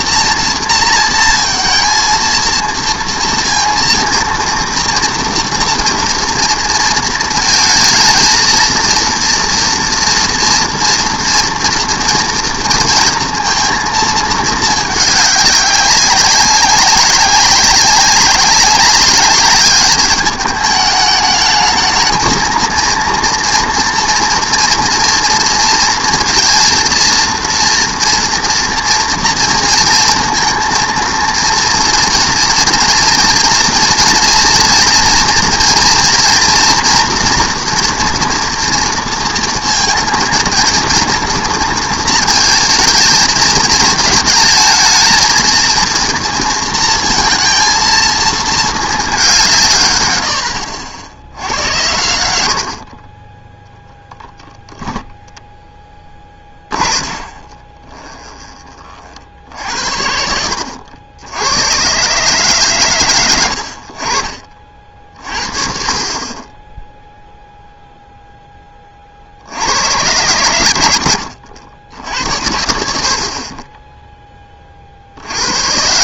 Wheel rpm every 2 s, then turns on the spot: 230, 230, 230, 230, 230, 230, 230, 220, 190, 190, 210, 230, 230, 230, 240, 230, 230, 230, 230, 230, 230, 230, 230, 230, 220, 50, 70, 10, 30, 30, 80, 100, 40, 20, 20, 90, 80, 30.
56-58